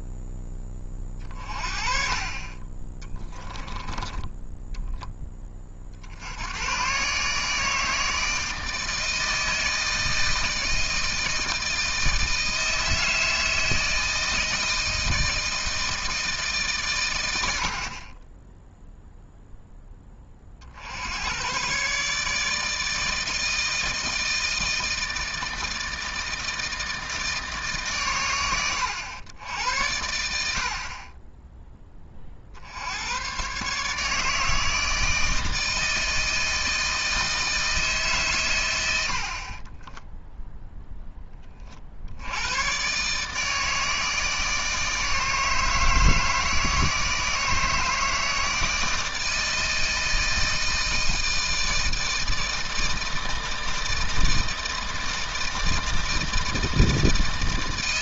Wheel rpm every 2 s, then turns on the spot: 20, 20, 10, 130, 160, 160, 160, 160, 120, 0, 70, 160, 160, 160, 100, 50, 80, 160, 160, 90, 0, 120, 160, 160, 160, 160, 160, 160, 160.
none